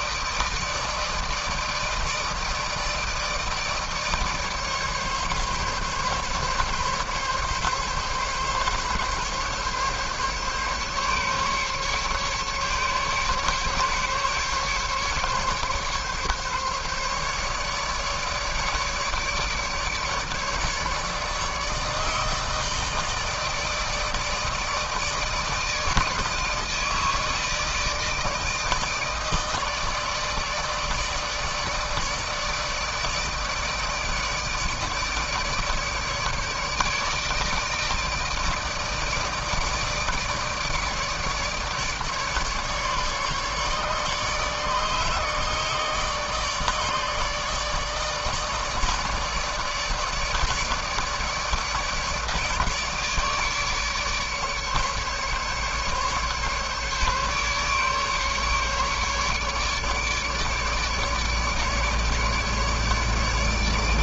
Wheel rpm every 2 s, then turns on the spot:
160, 160, 150, 140, 140, 140, 150, 140, 140, 150, 150, 160, 160, 160, 150, 150, 160, 160, 150, 160, 160, 150, 150, 150, 160, 150, 160, 150, 150, 150, 150, 150.
none